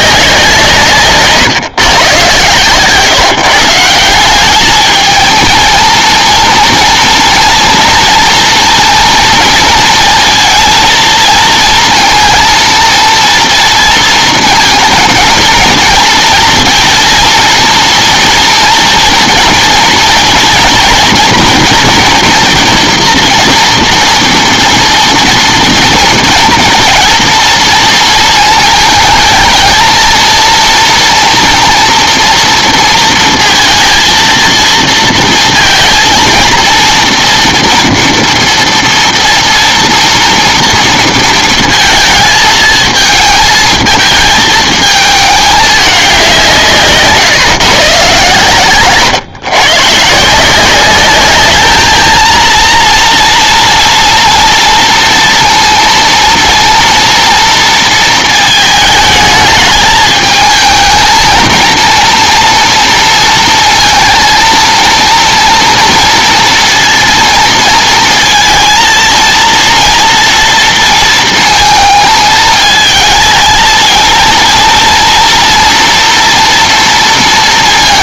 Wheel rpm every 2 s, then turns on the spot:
170, 130, 210, 230, 230, 230, 230, 230, 230, 230, 240, 230, 230, 230, 220, 230, 230, 230, 230, 230, 230, 220, 220, 170, 130, 180, 230, 230, 230, 220, 220, 230, 230, 230, 230, 230, 220, 230, 230.
none